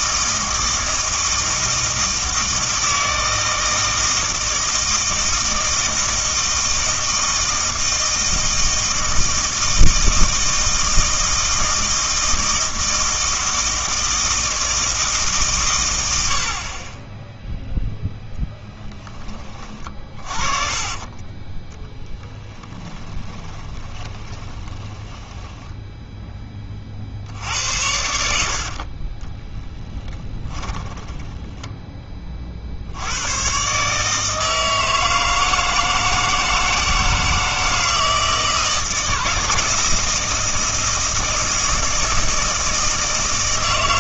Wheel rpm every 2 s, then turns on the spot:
160, 160, 160, 160, 160, 160, 160, 160, 40, 10, 30, 10, 20, 30, 50, 10, 60, 160, 160, 160, 160, 160.
20-26 28-32